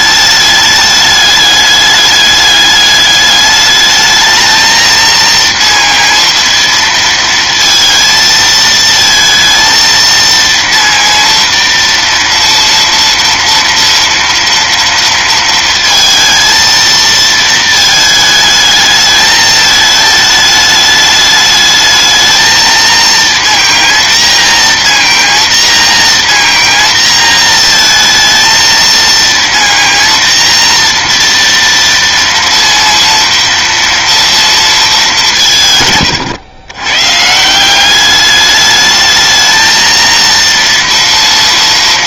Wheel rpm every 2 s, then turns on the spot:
210, 210, 220, 230, 220, 230, 230, 230, 230, 220, 210, 230, 230, 230, 230, 230, 230, 230, 110, 210, 230.
none